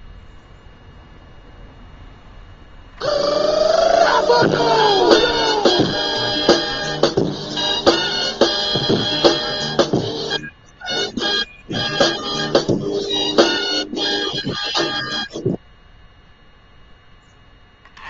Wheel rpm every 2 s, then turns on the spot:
0, 0, 0, 0, 0, 0, 0, 0, 10.
none